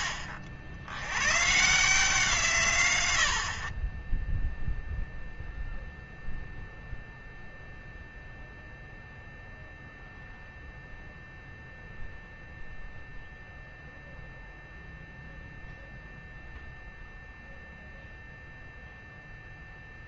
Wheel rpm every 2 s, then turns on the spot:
80, 120, 0, 0, 0, 0, 0, 0, 0, 0.
none